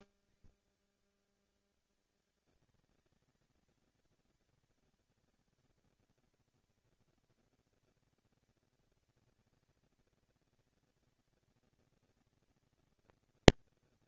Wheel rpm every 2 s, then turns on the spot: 140, 210, 230, 230, 230, 230, 230.
none